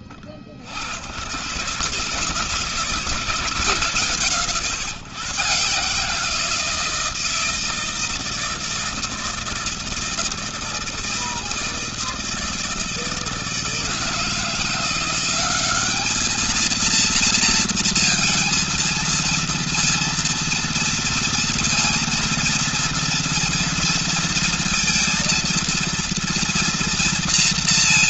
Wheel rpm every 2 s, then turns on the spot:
50, 150, 140, 160, 160, 160, 160, 170, 220, 230, 230, 230, 230, 230.
none